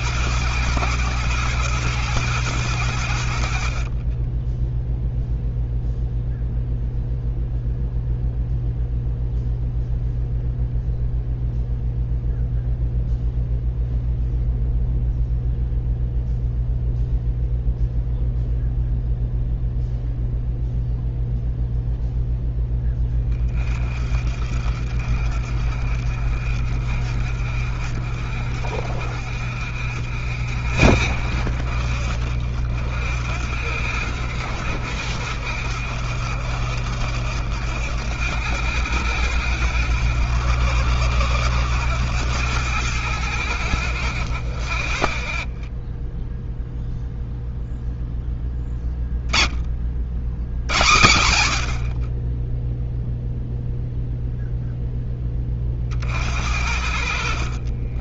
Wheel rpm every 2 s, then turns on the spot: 110, 40, 0, 0, 0, 0, 0, 0, 0, 0, 0, 30, 50, 50, 50, 50, 60, 70, 70, 80, 90, 80, 10, 0, 40, 40, 0, 50, 50.
none